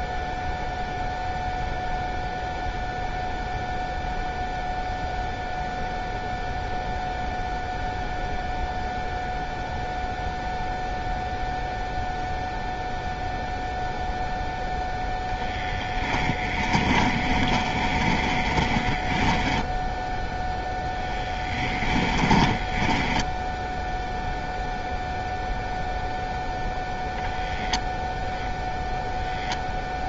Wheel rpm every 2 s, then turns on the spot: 0, 0, 0, 0, 0, 0, 0, 0, 20, 20, 0, 10, 0, 0, 0.
16-20 22-24